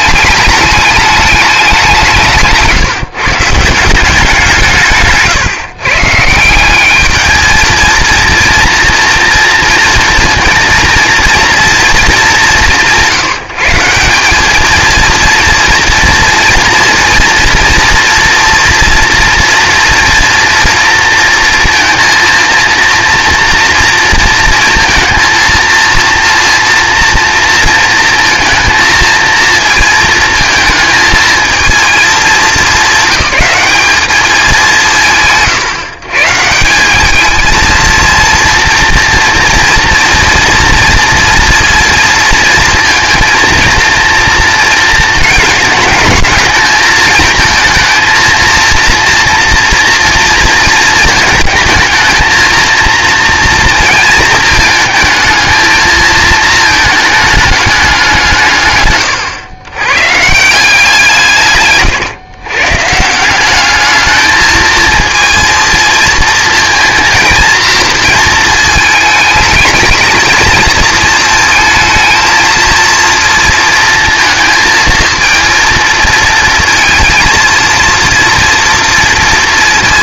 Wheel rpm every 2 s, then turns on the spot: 210, 160, 160, 200, 230, 230, 180, 230, 230, 230, 230, 230, 230, 230, 220, 220, 200, 140, 180, 240, 230, 230, 220, 220, 230, 230, 230, 220, 220, 130, 170, 150, 220, 230, 220, 220, 230, 230, 220, 230.
none